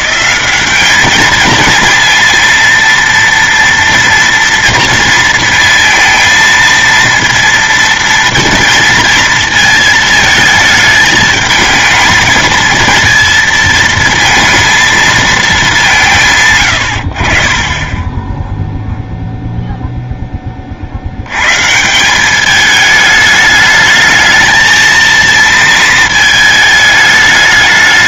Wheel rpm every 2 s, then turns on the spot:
200, 230, 230, 230, 230, 220, 220, 230, 120, 0, 40, 210, 220, 220.
none